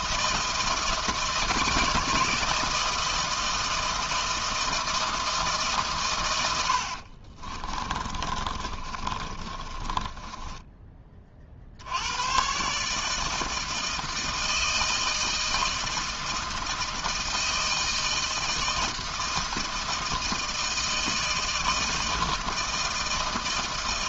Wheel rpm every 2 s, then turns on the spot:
160, 160, 160, 80, 30, 20, 140, 160, 160, 160, 160, 160.
6-12